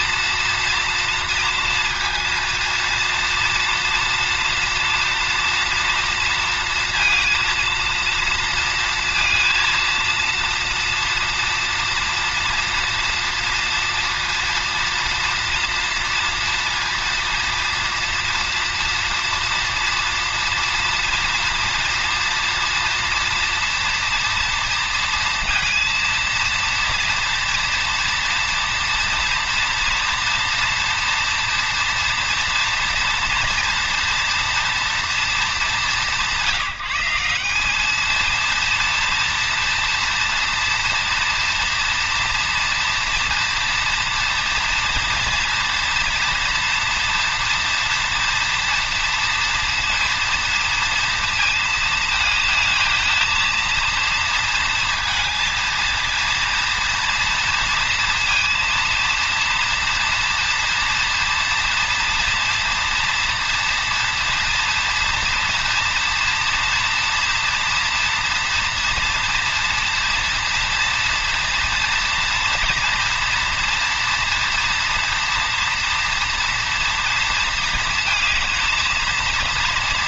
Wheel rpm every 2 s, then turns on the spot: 240, 230, 230, 230, 230, 230, 230, 230, 230, 230, 230, 230, 230, 230, 230, 230, 240, 230, 180, 230, 230, 230, 230, 230, 240, 240, 220, 230, 230, 230, 230, 230, 230, 240, 240, 230, 240, 230, 230, 220.
none